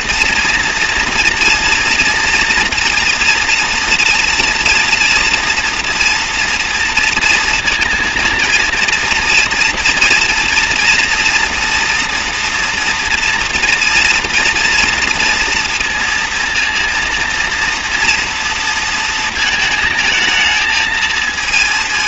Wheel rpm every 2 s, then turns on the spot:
230, 230, 230, 230, 230, 230, 240, 230, 230, 230, 220.
none